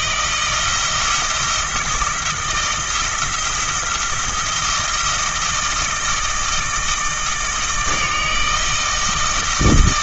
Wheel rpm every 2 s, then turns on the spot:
170, 170, 160, 160, 160.
none